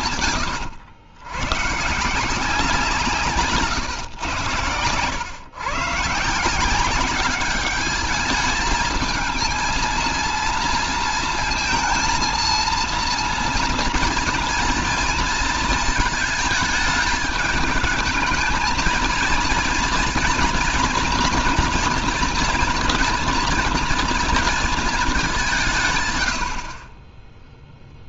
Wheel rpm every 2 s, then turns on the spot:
100, 170, 100, 180, 220, 230, 230, 230, 210, 220, 230, 230, 220, 50.
none